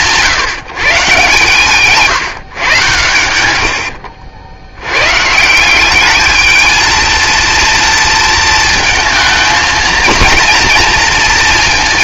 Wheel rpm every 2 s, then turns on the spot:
140, 90, 110, 230, 230, 230.
none